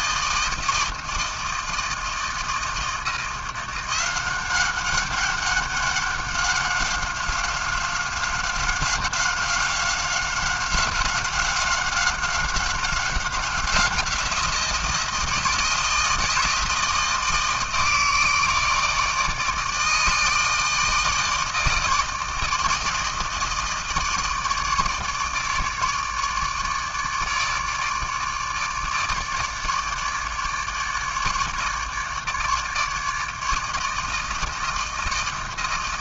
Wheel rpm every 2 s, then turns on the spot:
160, 170, 200, 190, 190, 190, 190, 160, 160, 160, 160, 160, 150, 150, 150, 150, 160, 160.
none